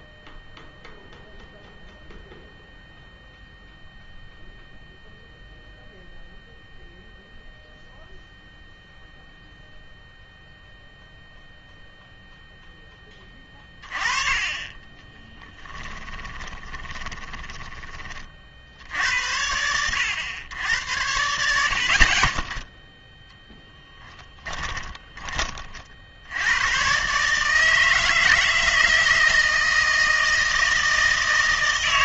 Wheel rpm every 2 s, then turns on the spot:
0, 0, 0, 0, 0, 0, 10, 30, 20, 60, 90, 10, 20, 110, 160, 160.
14-18 24-26